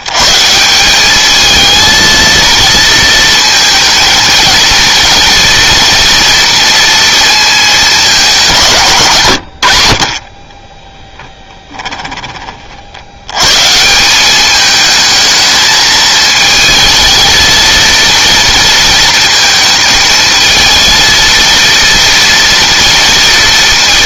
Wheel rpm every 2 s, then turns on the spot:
180, 230, 230, 230, 140, 20, 60, 210, 220, 230, 220, 230.
10-12